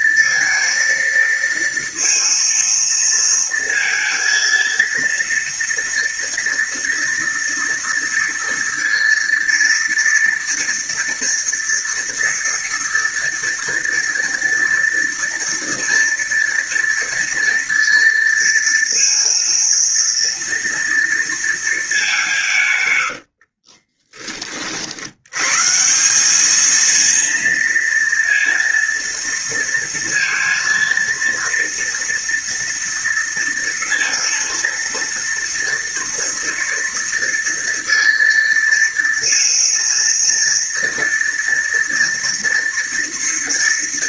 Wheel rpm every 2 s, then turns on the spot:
230, 230, 230, 230, 230, 230, 230, 230, 230, 230, 230, 120, 40, 220, 230, 230, 230, 230, 230, 230, 230, 230.
22-24